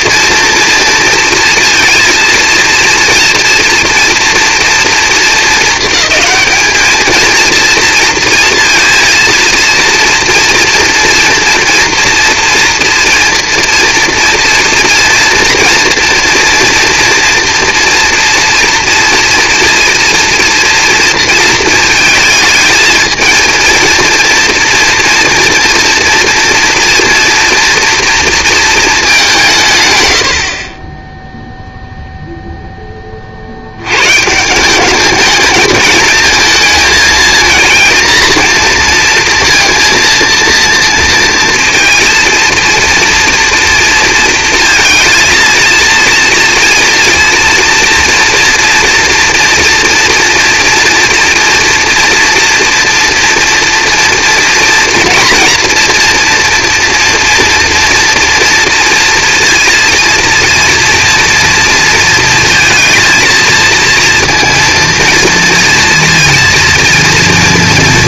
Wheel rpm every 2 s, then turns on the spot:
230, 230, 230, 220, 230, 230, 230, 230, 240, 230, 230, 220, 230, 230, 230, 50, 10, 180, 220, 230, 230, 230, 230, 230, 240, 230, 230, 240, 230, 230, 230, 220, 230, 230.
none